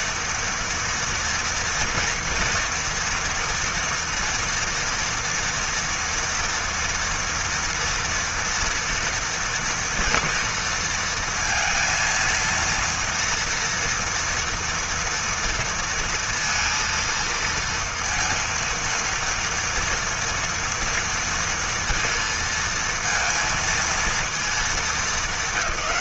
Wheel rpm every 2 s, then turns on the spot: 230, 230, 230, 240, 240, 230, 230, 230, 230, 230, 230, 230, 220.
none